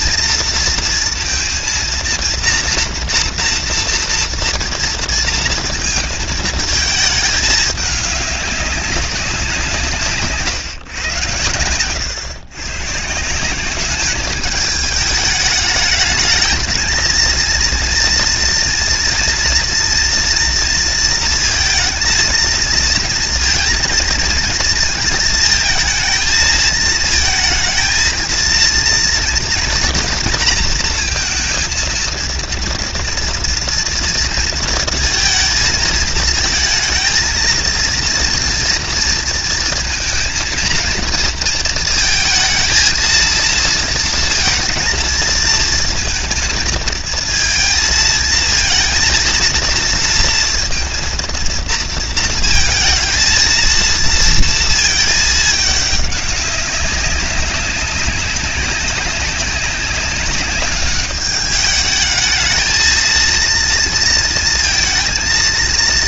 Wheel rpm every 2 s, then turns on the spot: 230, 240, 230, 220, 200, 130, 150, 220, 220, 230, 230, 230, 220, 220, 230, 230, 230, 230, 230, 230, 230, 230, 230, 230, 220, 230, 220, 220, 200, 200, 200, 230, 230.
none